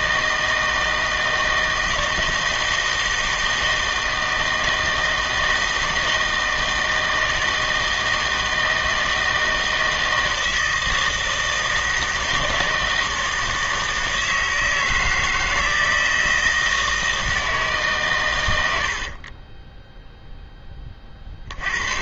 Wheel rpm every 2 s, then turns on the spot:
160, 160, 160, 160, 160, 160, 160, 160, 160, 80, 20.
18-20